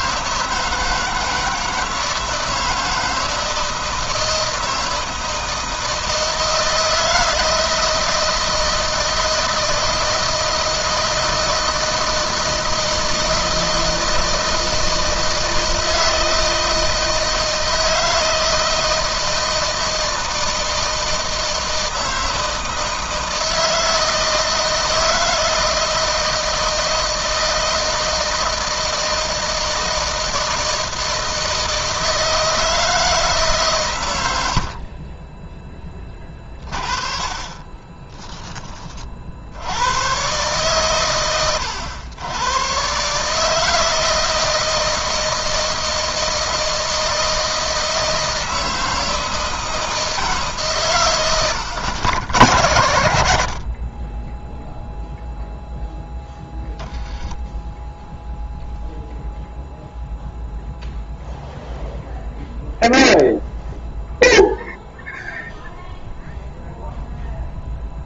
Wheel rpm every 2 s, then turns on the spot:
160, 160, 160, 160, 160, 160, 160, 160, 160, 160, 160, 160, 160, 160, 160, 160, 160, 50, 30, 40, 120, 140, 160, 160, 160, 130, 110, 0, 10, 0, 0, 0, 0, 0.
none